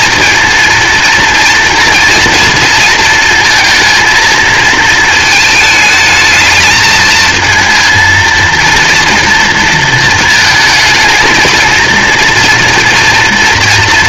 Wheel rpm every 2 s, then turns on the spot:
230, 230, 220, 220, 230, 220, 230.
none